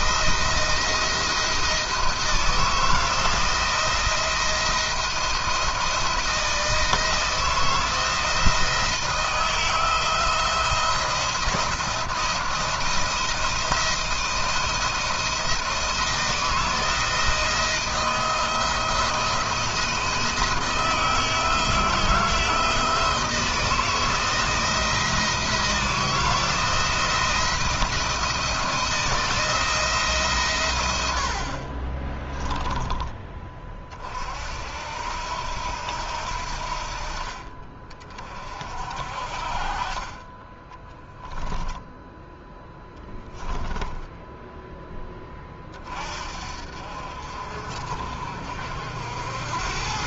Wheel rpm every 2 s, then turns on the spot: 170, 170, 170, 170, 160, 170, 170, 170, 160, 160, 170, 170, 170, 170, 170, 100, 20, 70, 50, 50, 10, 10, 10, 50, 70.
40-44